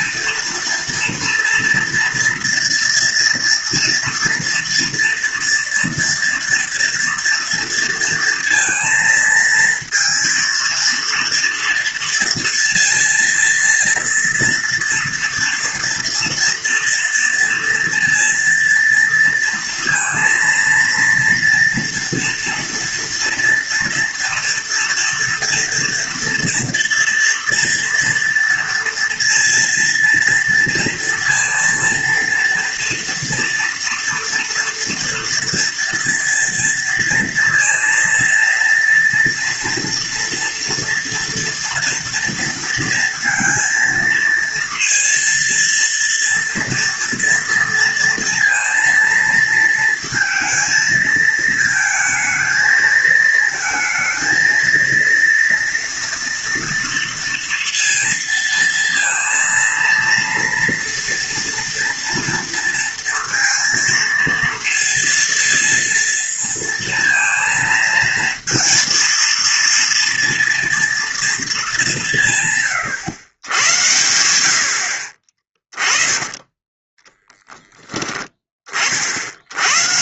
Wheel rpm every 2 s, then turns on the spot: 230, 230, 230, 230, 230, 230, 230, 240, 230, 230, 230, 240, 230, 230, 230, 230, 230, 240, 230, 240, 230, 230, 230, 230, 230, 230, 230, 230, 230, 230, 230, 230, 230, 230, 230, 230, 120, 60, 20, 30.
76-78